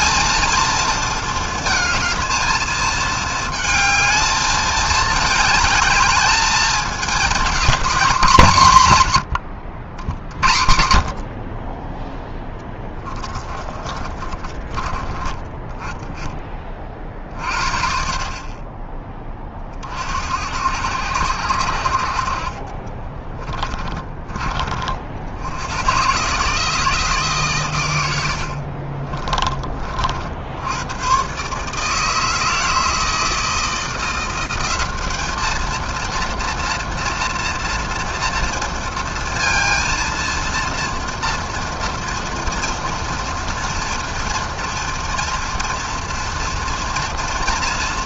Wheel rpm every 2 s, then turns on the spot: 230, 220, 220, 220, 190, 80, 10, 30, 20, 30, 80, 40, 50, 150, 70, 70, 160, 180, 230, 230, 230, 230, 240, 240.
12-16 22-24 28-30